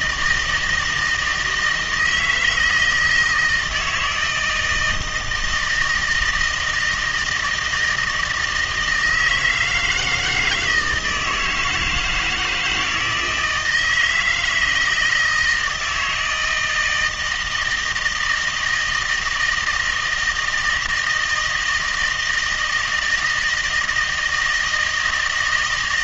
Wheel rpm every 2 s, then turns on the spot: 160, 160, 160, 160, 160, 160, 160, 160, 160, 160, 160, 170, 160.
none